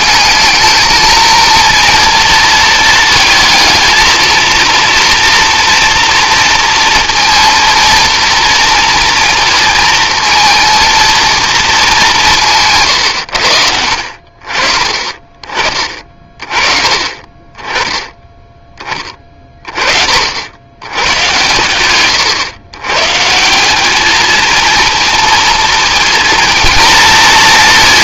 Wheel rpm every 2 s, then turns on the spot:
220, 230, 230, 230, 230, 230, 150, 40, 30, 20, 90, 120, 230, 230.
none